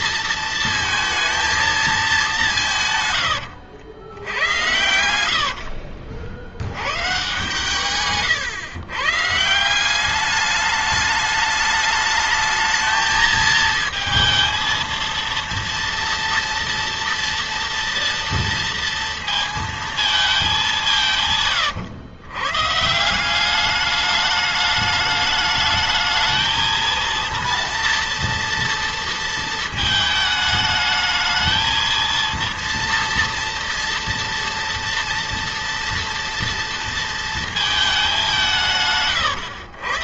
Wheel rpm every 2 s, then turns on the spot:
230, 170, 80, 90, 110, 200, 220, 230, 230, 230, 210, 150, 210, 220, 230, 220, 230, 230, 230, 170.
none